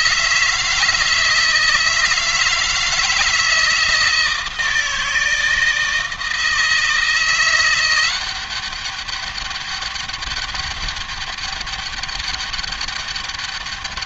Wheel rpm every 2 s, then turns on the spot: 160, 160, 160, 170, 200, 200, 200.
none